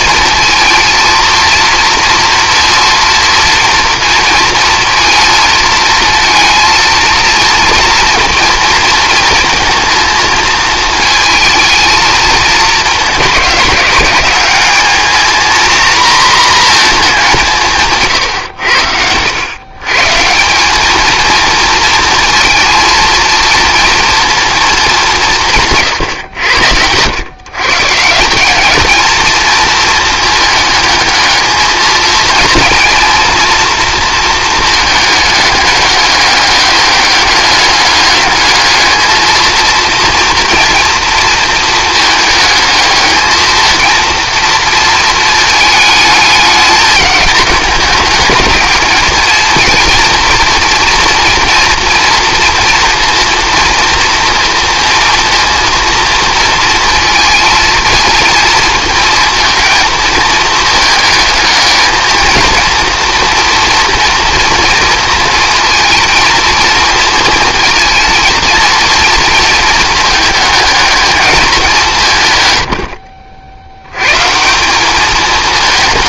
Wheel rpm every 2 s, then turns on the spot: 230, 230, 230, 230, 230, 220, 210, 210, 230, 90, 210, 230, 220, 100, 210, 220, 230, 220, 200, 220, 230, 220, 230, 220, 220, 230, 230, 230, 230, 230, 220, 230, 230, 230, 230, 210, 90, 200.
none